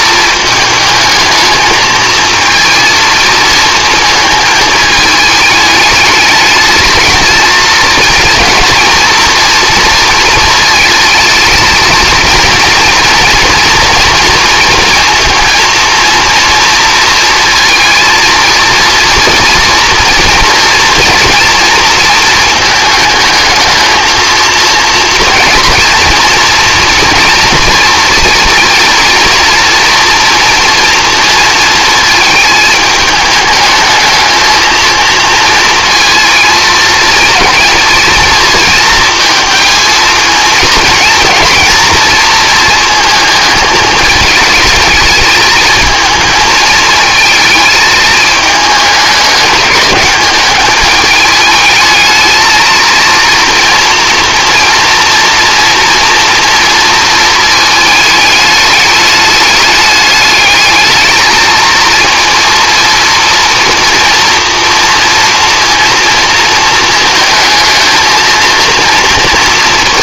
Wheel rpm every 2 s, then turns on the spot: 220, 230, 220, 220, 230, 220, 230, 230, 230, 240, 230, 220, 230, 230, 230, 230, 220, 230, 230, 220, 220, 230, 210, 220, 210, 210, 230, 230, 230, 210, 220, 230, 230, 220, 230.
none